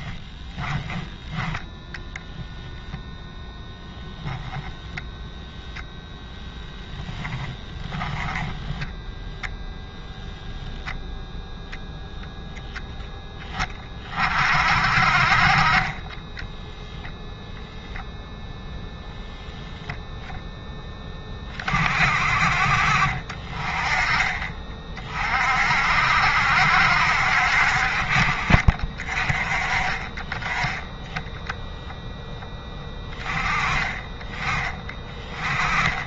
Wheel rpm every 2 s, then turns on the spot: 10, 0, 0, 0, 10, 0, 0, 50, 0, 0, 10, 50, 40, 70, 40, 10, 10, 20.
0-2